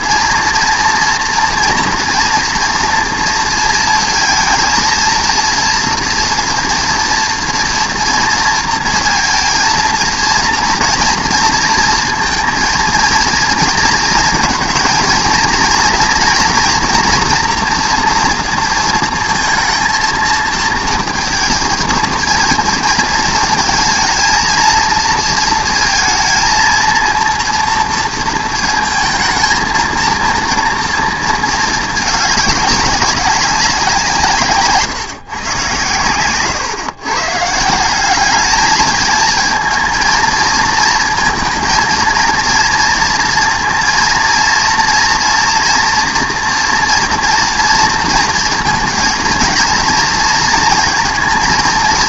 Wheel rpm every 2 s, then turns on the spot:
230, 230, 230, 240, 230, 230, 230, 220, 230, 230, 230, 230, 230, 230, 230, 230, 210, 150, 130, 210, 230, 230, 230, 230, 230, 230.
none